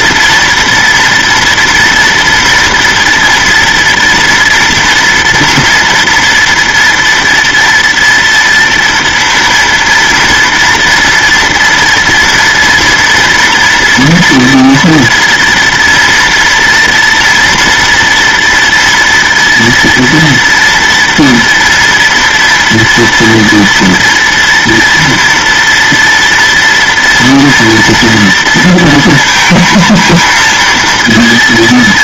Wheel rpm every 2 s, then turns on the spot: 230, 230, 230, 230, 230, 230, 240, 230, 230, 230, 230, 230, 230, 230, 230, 230.
none